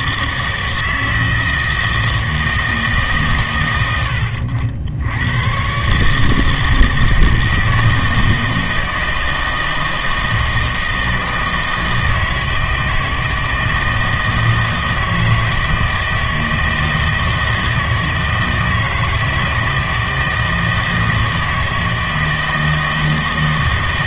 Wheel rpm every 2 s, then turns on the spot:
160, 160, 80, 160, 160, 160, 160, 160, 160, 160, 160, 160.
none